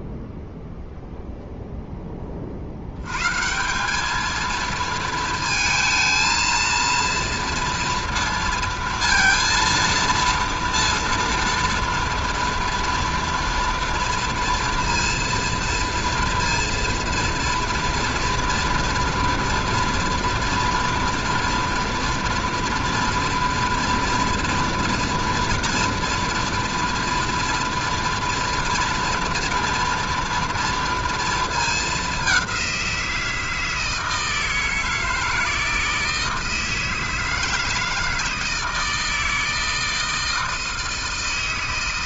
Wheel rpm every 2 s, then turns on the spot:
0, 50, 220, 230, 230, 230, 230, 230, 230, 230, 230, 230, 230, 230, 240, 230, 190, 160, 160, 160, 160.
none